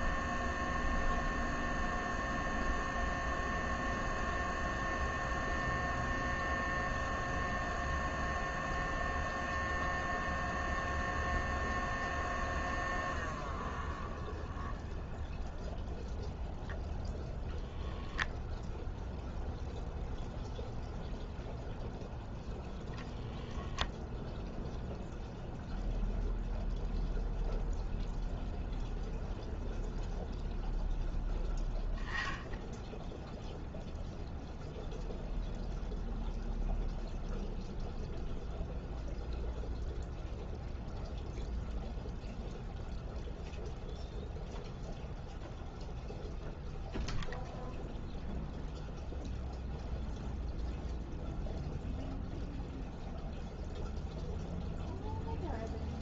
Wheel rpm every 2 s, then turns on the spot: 0, 0, 0, 0, 0, 0, 0, 0, 0, 0, 0, 0, 0, 0, 0, 0, 0, 0, 0, 0, 0, 0, 0, 0, 0, 0, 0, 0.
none